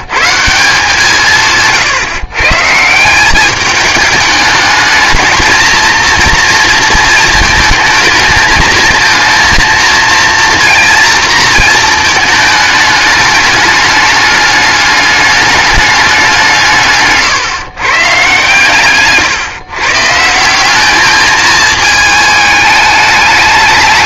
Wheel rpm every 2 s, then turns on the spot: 170, 150, 210, 230, 220, 230, 210, 210, 160, 130, 190, 210.
none